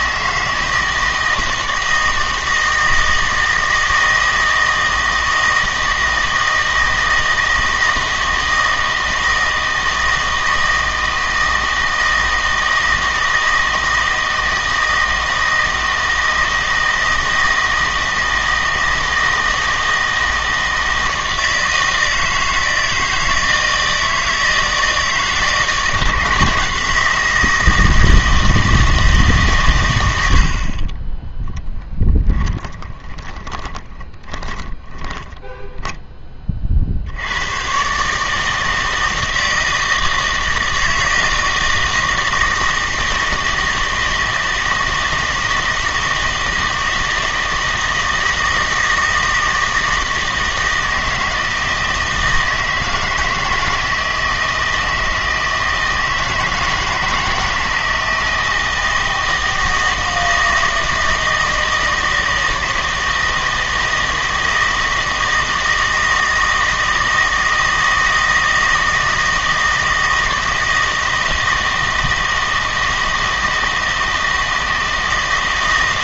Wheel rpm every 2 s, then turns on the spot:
160, 160, 160, 160, 160, 160, 160, 160, 160, 160, 160, 160, 160, 170, 160, 40, 20, 10, 50, 160, 160, 160, 160, 160, 160, 160, 160, 160, 160, 160, 160, 160, 160, 160, 160, 160, 160, 160.
32-36